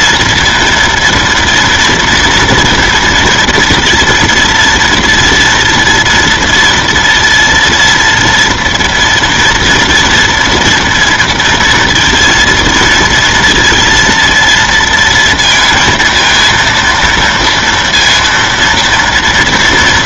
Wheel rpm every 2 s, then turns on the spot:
230, 230, 230, 240, 230, 230, 230, 230, 230, 230.
none